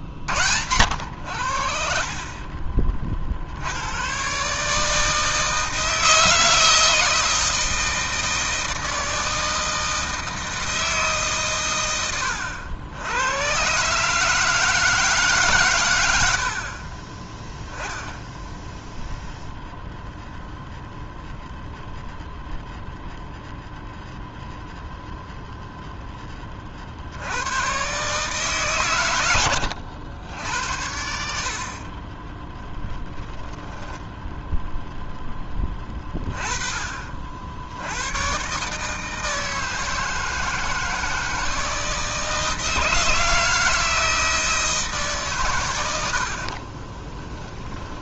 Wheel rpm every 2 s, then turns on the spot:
90, 40, 150, 160, 160, 160, 90, 160, 40, 0, 0, 0, 0, 60, 120, 80, 10, 0, 30, 150, 160, 160, 160, 20.
32-34 46-48